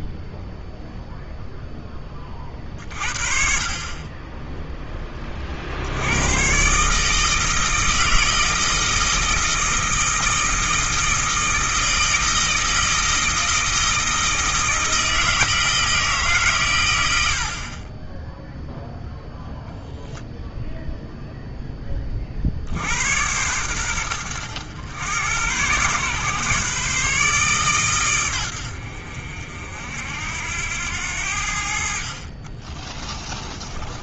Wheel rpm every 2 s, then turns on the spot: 0, 40, 10, 140, 160, 160, 160, 160, 100, 0, 0, 80, 100, 140, 80, 90, 30.
32-34